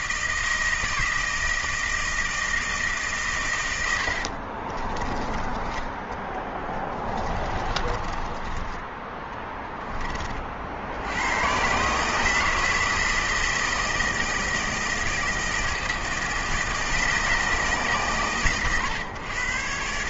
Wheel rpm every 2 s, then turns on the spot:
160, 160, 40, 20, 20, 50, 160, 160, 160, 130.
4-10